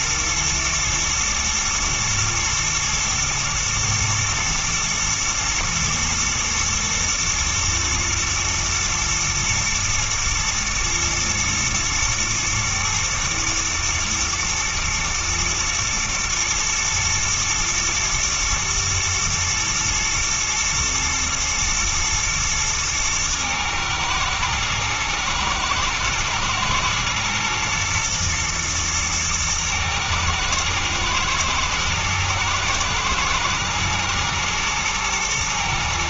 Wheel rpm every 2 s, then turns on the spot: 110, 110, 110, 110, 120, 110, 110, 120, 110, 110, 110, 110, 120, 120, 120, 120, 110, 110.
none